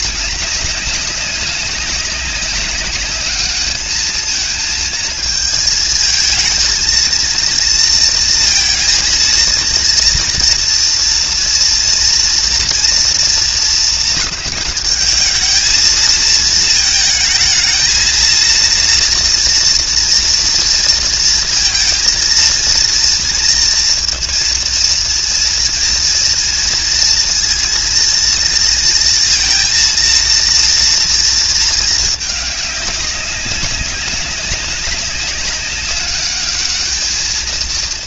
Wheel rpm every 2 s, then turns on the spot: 200, 200, 220, 220, 230, 230, 230, 210, 220, 230, 230, 230, 230, 230, 230, 230, 200, 200, 210.
none